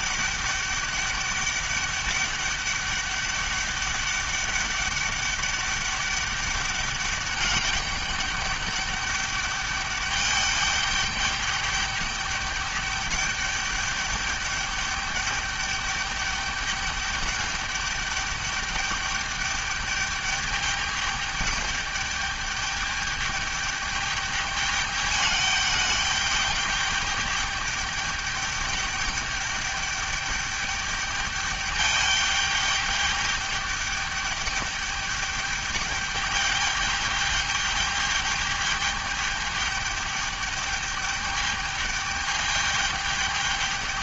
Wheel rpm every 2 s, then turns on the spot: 200, 210, 200, 200, 200, 200, 200, 200, 210, 210, 200, 210, 210, 210, 200, 210, 210, 210, 210, 210, 210, 210.
none